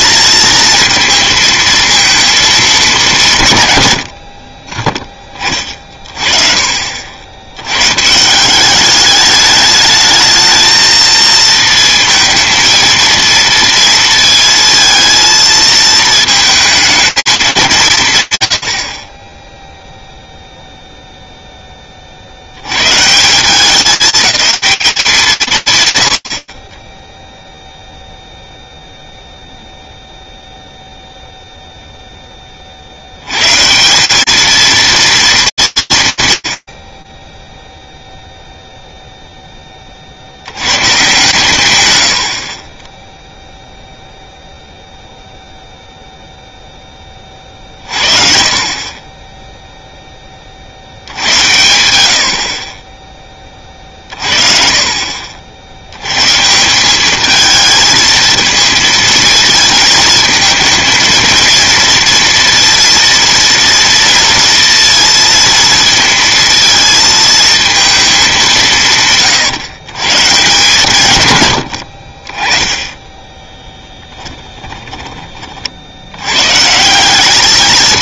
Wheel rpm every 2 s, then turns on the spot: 230, 220, 30, 40, 190, 220, 230, 230, 220, 80, 0, 110, 210, 40, 0, 0, 140, 240, 40, 0, 130, 0, 0, 40, 10, 100, 30, 60, 220, 220, 230, 230, 230, 220, 130, 100, 10, 30, 210.
72-74